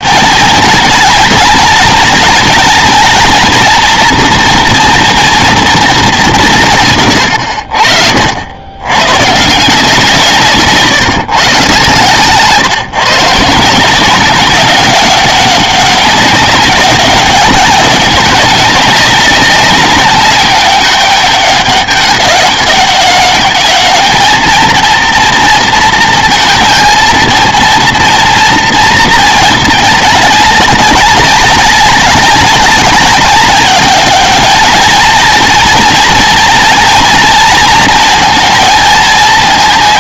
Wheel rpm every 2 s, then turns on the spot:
230, 230, 240, 170, 90, 150, 140, 190, 200, 190, 200, 200, 230, 220, 230, 200, 200, 210, 230, 230.
none